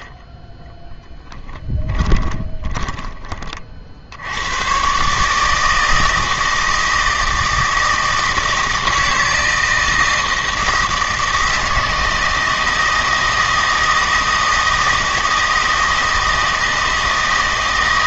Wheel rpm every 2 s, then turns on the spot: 10, 20, 120, 160, 160, 160, 160, 160, 160.
2-4